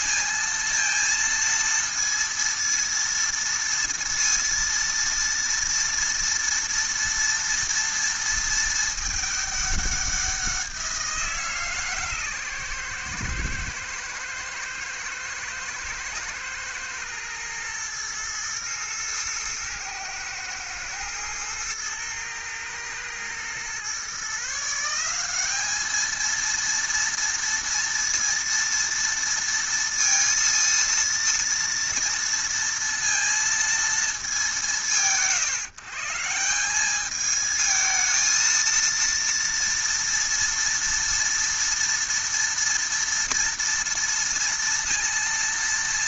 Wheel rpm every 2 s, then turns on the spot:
230, 230, 230, 230, 220, 180, 130, 110, 120, 110, 110, 110, 150, 230, 230, 230, 230, 140, 170, 230, 230, 230, 230.
none